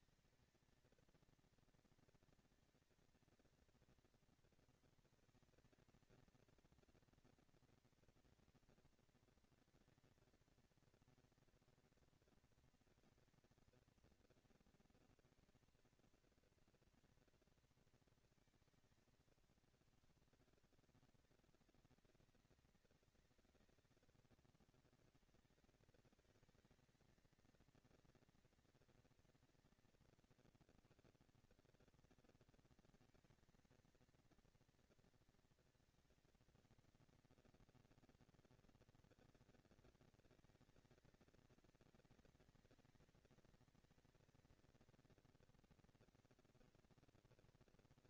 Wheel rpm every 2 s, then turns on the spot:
220, 230, 230, 230, 230, 230, 230, 230, 230, 230, 200, 190, 200, 220, 230, 160, 220, 230, 230, 240, 230, 220, 230, 230.
none